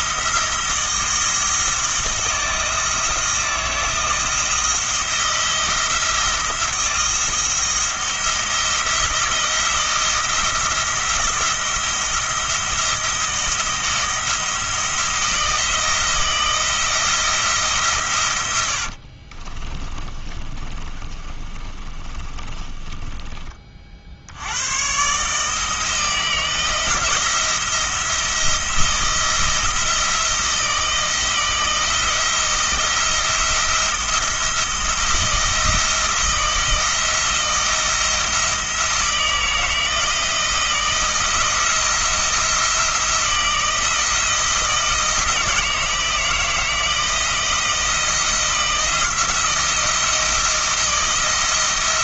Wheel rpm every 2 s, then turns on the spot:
170, 160, 160, 170, 170, 170, 170, 160, 160, 90, 30, 20, 100, 160, 170, 170, 170, 170, 170, 170, 160, 170, 160, 160, 170, 170.
20-24